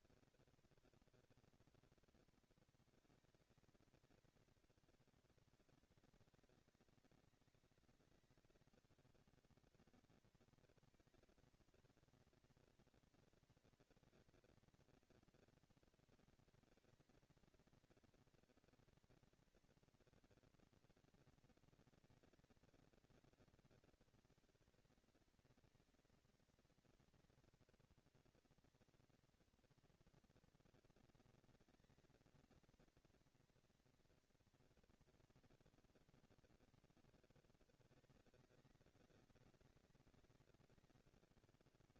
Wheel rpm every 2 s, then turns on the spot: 230, 230, 210, 200, 200, 230, 230, 230, 230, 230, 230, 230, 230, 230, 230, 230, 230, 230, 230, 200, 200.
none